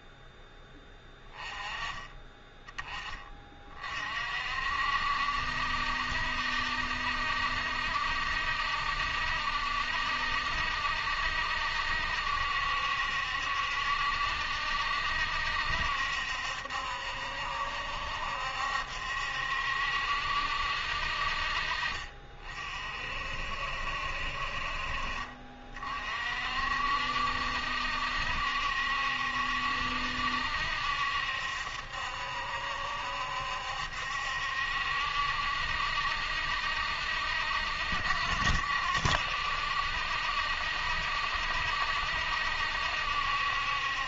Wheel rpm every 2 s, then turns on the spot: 10, 20, 60, 70, 70, 70, 70, 70, 70, 70, 60, 40, 50, 60, 70, 70, 70, 70, 70, 70, 70, 70.
none